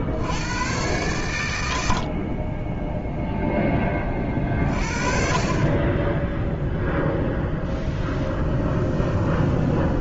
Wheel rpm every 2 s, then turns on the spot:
110, 10, 40, 0, 10.
8-10